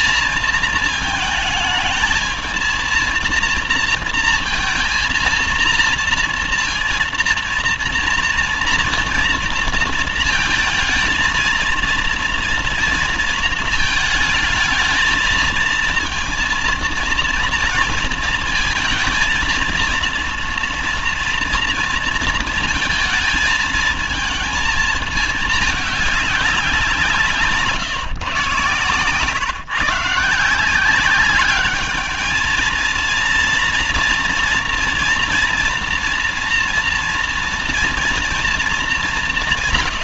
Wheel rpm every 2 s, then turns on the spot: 220, 220, 230, 230, 230, 220, 230, 220, 230, 230, 230, 230, 220, 190, 130, 170, 230, 230, 230, 220.
none